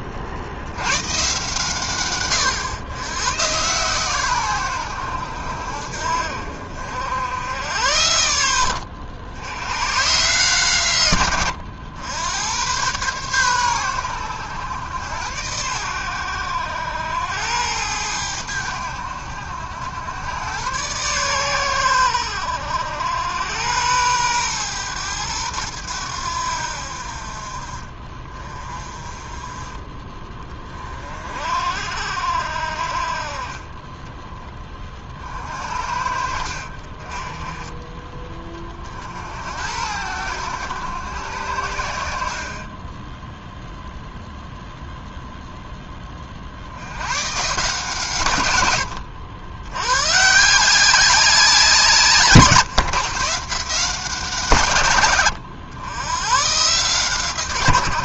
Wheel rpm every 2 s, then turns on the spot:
70, 110, 100, 60, 80, 130, 110, 100, 80, 90, 110, 80, 110, 70, 30, 30, 60, 20, 50, 30, 100, 50, 0, 70, 110, 170, 140, 150, 140.
none